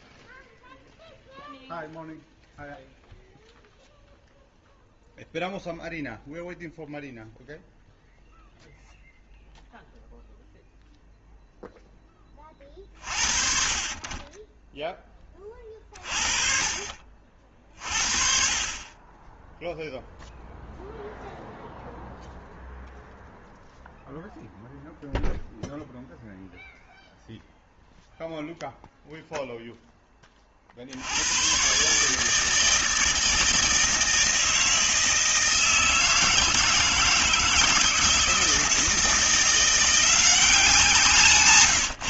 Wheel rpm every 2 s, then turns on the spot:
0, 0, 0, 0, 0, 0, 30, 10, 40, 30, 0, 0, 0, 0, 0, 50, 160, 160, 160, 160, 180.
none